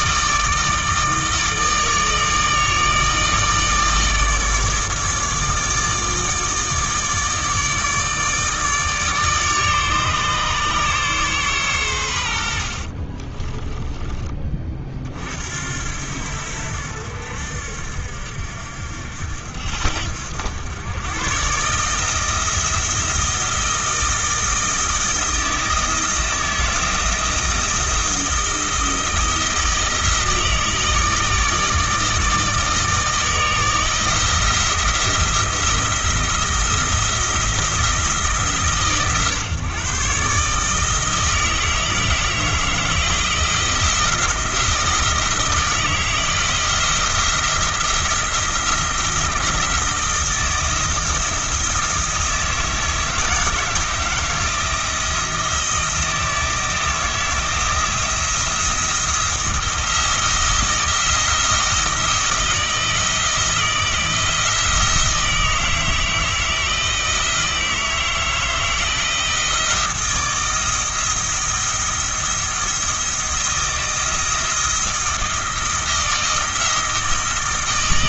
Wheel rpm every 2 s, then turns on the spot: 160, 160, 160, 160, 150, 140, 60, 40, 70, 70, 100, 160, 160, 170, 160, 160, 160, 160, 170, 140, 160, 160, 160, 160, 170, 160, 160, 160, 160, 170, 170, 160, 170, 160, 160, 160, 170, 170, 160.
12-14